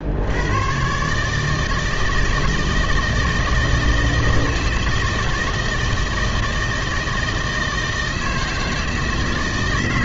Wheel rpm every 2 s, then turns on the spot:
120, 160, 160, 160, 160.
none